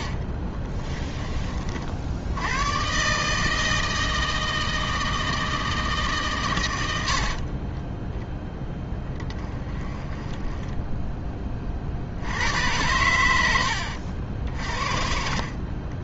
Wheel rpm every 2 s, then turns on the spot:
40, 130, 160, 90, 10, 10, 100, 50.
0-2 10-12